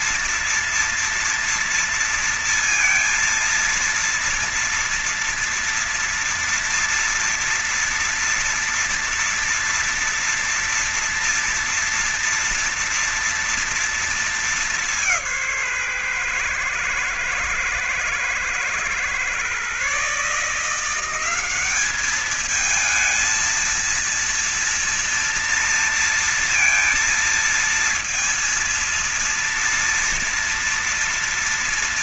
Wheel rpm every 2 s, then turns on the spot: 230, 230, 230, 230, 230, 230, 230, 190, 120, 120, 170, 220, 230, 230, 230, 230.
none